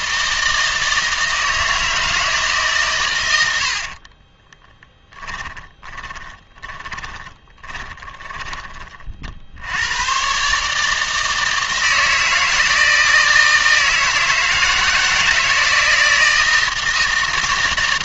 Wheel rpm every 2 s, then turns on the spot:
160, 140, 10, 20, 30, 150, 160, 160, 160.
4-8